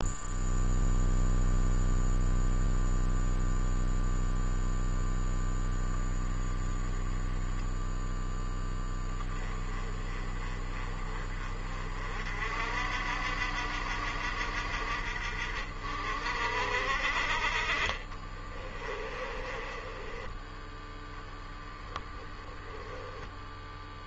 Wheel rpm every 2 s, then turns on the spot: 0, 0, 0, 10, 0, 30, 50, 60, 50, 20, 20, 20.
6-8 18-20 22-24